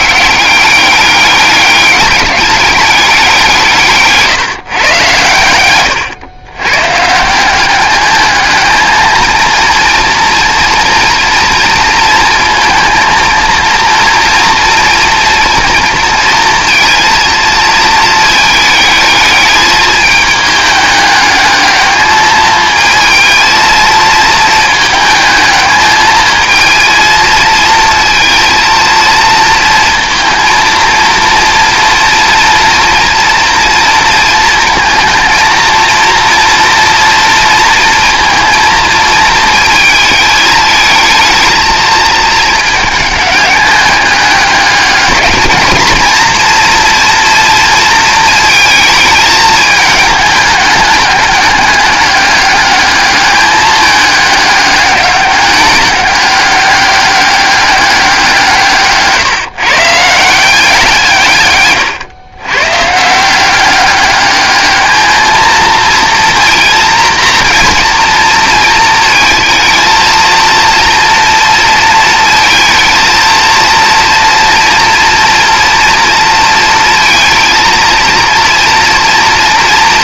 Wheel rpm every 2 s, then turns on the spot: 190, 200, 140, 130, 220, 230, 230, 230, 230, 220, 210, 220, 220, 220, 230, 230, 230, 220, 230, 220, 220, 210, 210, 240, 220, 210, 210, 200, 200, 150, 180, 130, 210, 230, 230, 240, 230, 230, 230, 230.
none